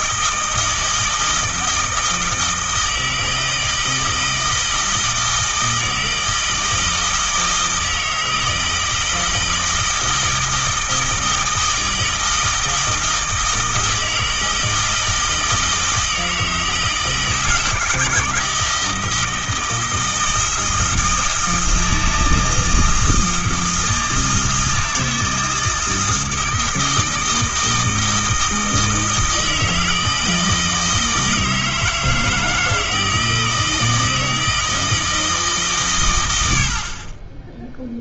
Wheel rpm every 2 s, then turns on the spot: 160, 160, 160, 160, 160, 160, 160, 160, 160, 160, 160, 160, 160, 160, 160, 160, 160, 160, 50.
none